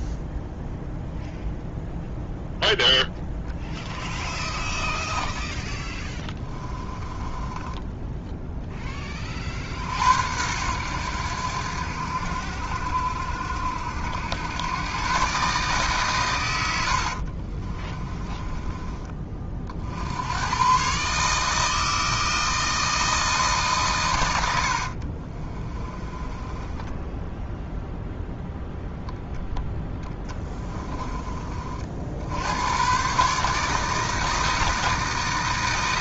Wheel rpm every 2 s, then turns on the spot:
0, 0, 20, 20, 10, 90, 70, 110, 90, 20, 120, 160, 60, 10, 0, 20, 100, 160.
4-8 16-18 24-28 30-32